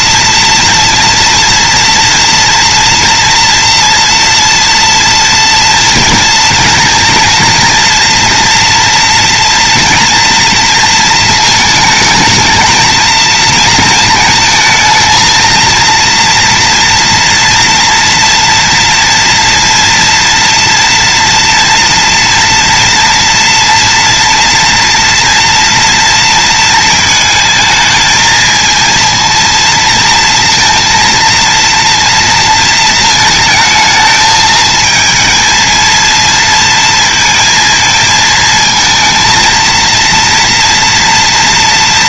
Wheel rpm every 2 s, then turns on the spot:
240, 230, 230, 230, 230, 230, 220, 220, 230, 230, 230, 230, 230, 220, 230, 230, 220, 220, 230, 220, 230.
none